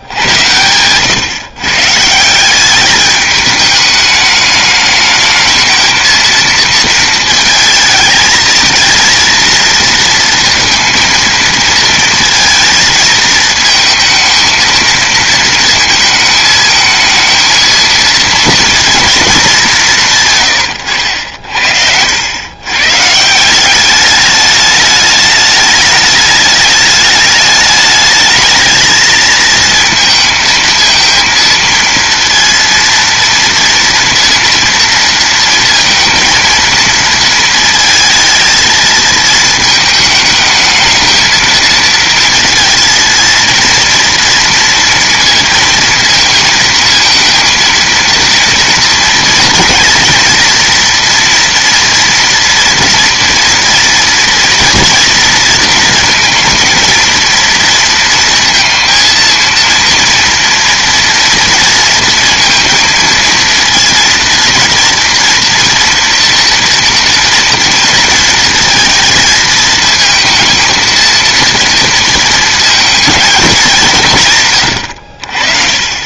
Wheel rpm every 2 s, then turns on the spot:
120, 200, 210, 220, 220, 230, 230, 230, 220, 230, 110, 130, 210, 210, 220, 230, 230, 230, 230, 230, 220, 230, 230, 230, 240, 240, 230, 230, 230, 230, 230, 230, 230, 230, 230, 230, 230, 110.
20-22 74-76